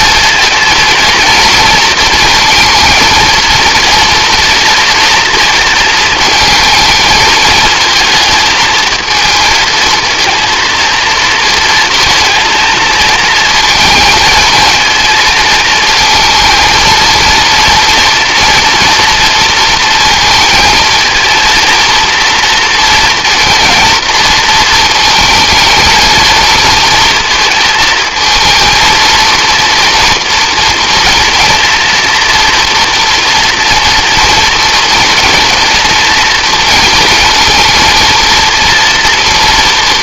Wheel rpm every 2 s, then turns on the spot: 230, 230, 230, 220, 220, 230, 230, 230, 230, 230, 230, 230, 230, 230, 220, 230, 230, 230, 220, 230.
none